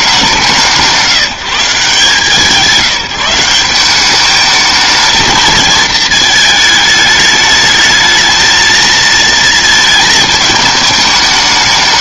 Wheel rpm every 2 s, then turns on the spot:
180, 160, 210, 220, 220, 220.
none